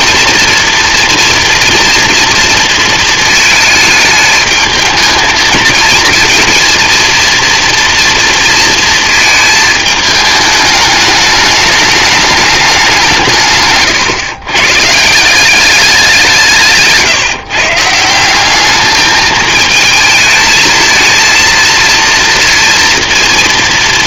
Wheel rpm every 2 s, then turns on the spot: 230, 230, 220, 230, 230, 210, 210, 130, 160, 190, 220, 230.
none